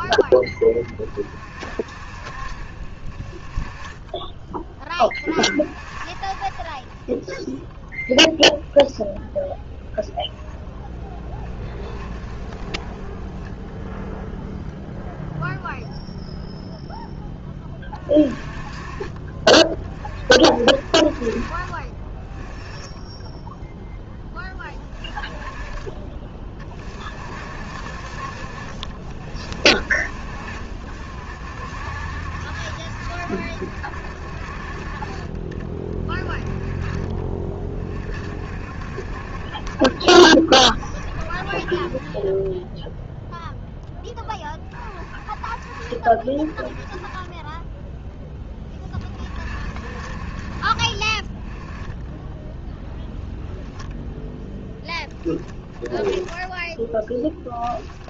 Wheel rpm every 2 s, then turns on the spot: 20, 40, 10, 20, 10, 10, 10, 0, 0, 30, 50, 10, 20, 40, 50, 60, 70, 40, 30, 60, 50, 0, 40, 30, 30, 40, 0, 20, 10.
10-14 54-58